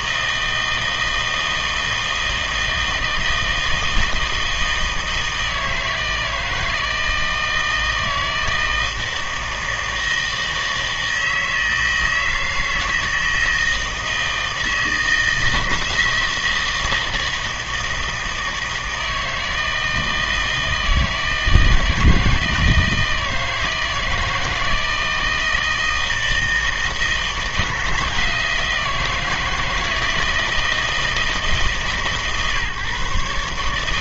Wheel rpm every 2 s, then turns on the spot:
160, 160, 160, 160, 160, 160, 160, 160, 160, 160, 160, 160, 160, 160, 160, 160, 150.
none